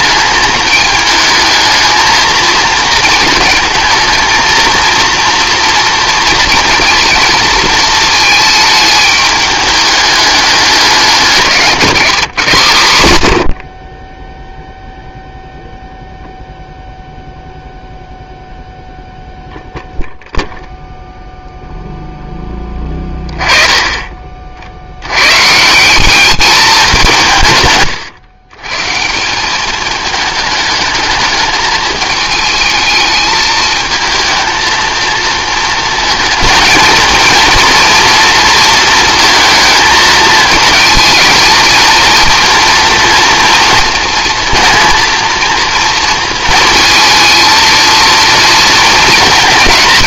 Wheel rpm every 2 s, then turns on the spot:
220, 230, 230, 230, 210, 210, 140, 0, 0, 0, 0, 10, 60, 190, 130, 210, 220, 220, 220, 230, 220, 230, 230, 230, 230.
none